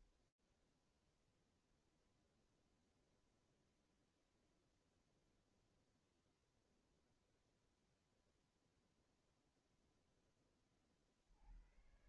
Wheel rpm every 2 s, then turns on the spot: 20, 0, 0, 0, 0, 80.
none